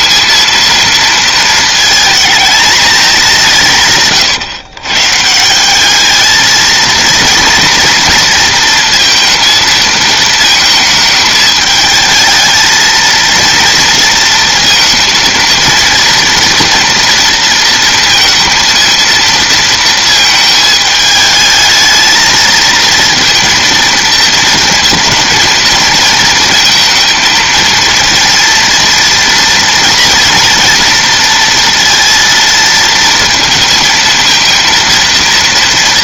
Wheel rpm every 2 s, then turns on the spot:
230, 210, 120, 220, 230, 220, 220, 230, 240, 230, 220, 220, 230, 230, 230, 230, 230, 230.
none